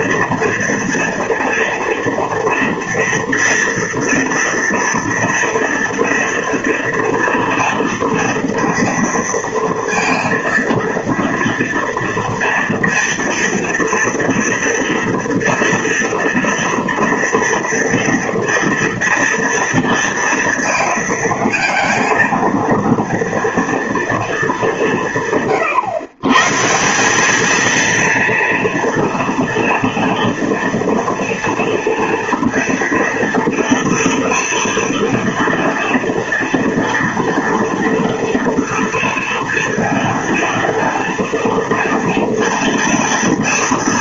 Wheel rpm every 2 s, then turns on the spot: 240, 230, 230, 230, 230, 230, 230, 230, 230, 230, 230, 230, 230, 120, 230, 240, 230, 230, 230, 230, 230, 230.
none